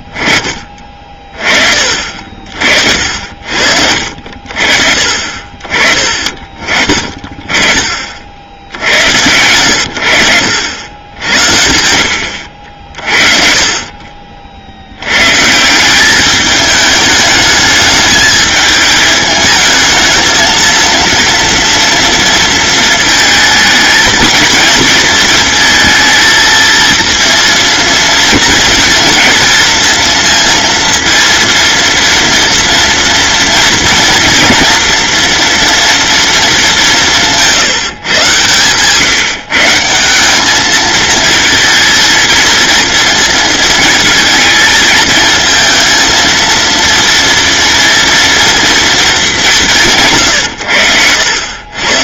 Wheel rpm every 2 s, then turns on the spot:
30, 60, 40, 30, 80, 90, 50, 90, 210, 210, 230, 230, 230, 230, 230, 230, 230, 240, 180, 140, 220, 230, 220, 230, 230, 100.
12-14